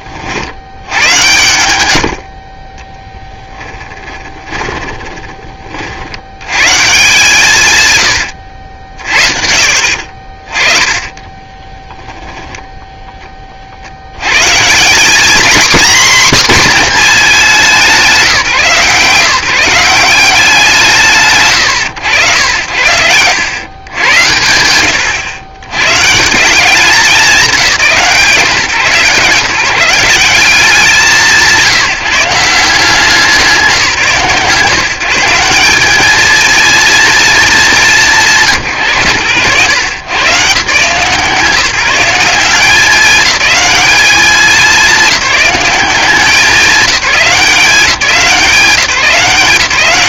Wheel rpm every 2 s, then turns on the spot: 80, 20, 20, 140, 80, 30, 10, 150, 250, 140, 190, 90, 110, 190, 150, 180, 180, 140, 230, 150, 150, 200, 190, 200, 190.
4-6 8-12